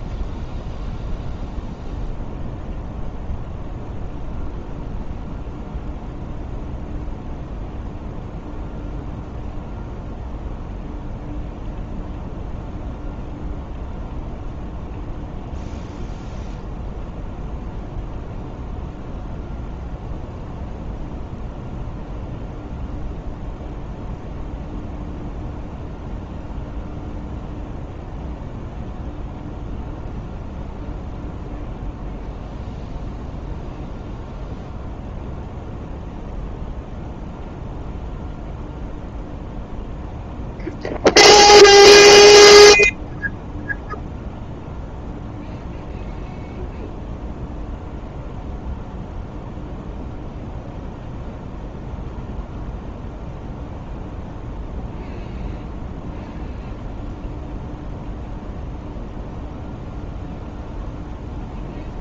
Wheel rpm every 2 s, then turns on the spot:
0, 0, 0, 0, 0, 0, 0, 0, 0, 0, 0, 0, 0, 0, 0, 0, 0, 0, 0, 0, 0, 0, 0, 0, 0, 0, 0, 0, 0, 0, 0.
none